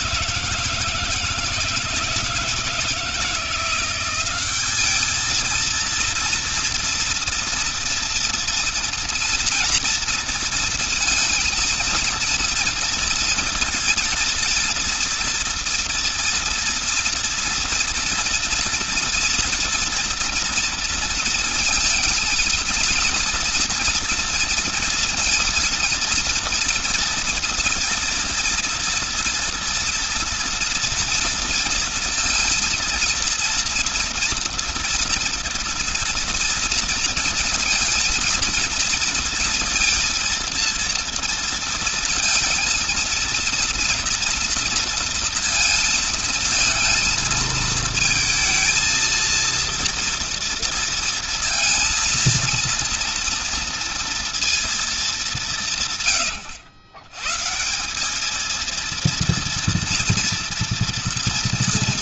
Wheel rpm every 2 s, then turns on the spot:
160, 160, 200, 240, 230, 230, 230, 230, 230, 240, 230, 230, 230, 230, 230, 230, 230, 230, 230, 230, 230, 230, 230, 220, 230, 230, 230, 230, 130, 210, 230.
none